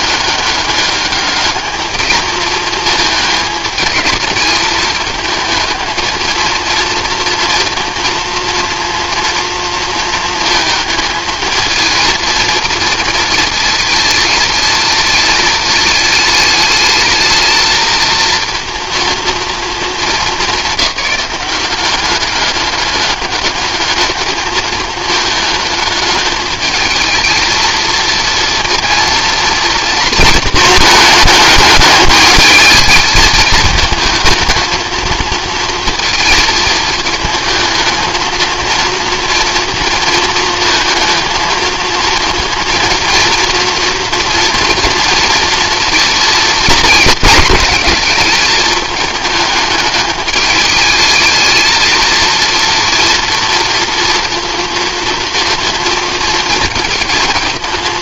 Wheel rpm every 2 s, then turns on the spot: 200, 220, 210, 220, 230, 220, 220, 220, 220, 230, 200, 200, 220, 220, 230, 220, 220, 220, 220, 230, 220, 230, 230, 220, 210, 210, 230, 230, 230.
none